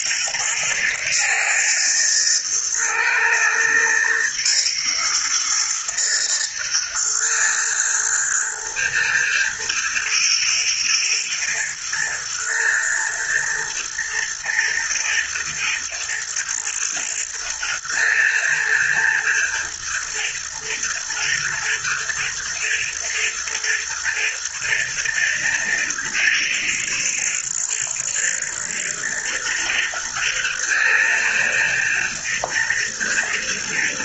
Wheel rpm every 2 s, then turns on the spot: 110, 110, 120, 110, 120, 110, 120, 110, 120, 110, 110, 120, 110, 110, 110, 110, 110.
none